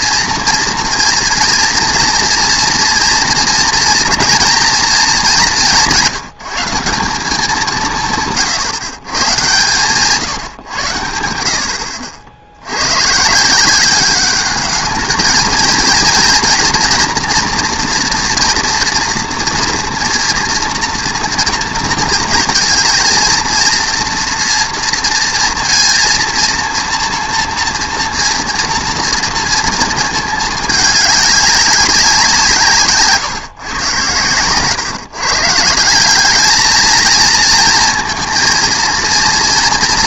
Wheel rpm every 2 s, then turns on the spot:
230, 230, 230, 180, 140, 130, 80, 210, 240, 240, 230, 220, 230, 230, 230, 210, 170, 120, 220, 230.
none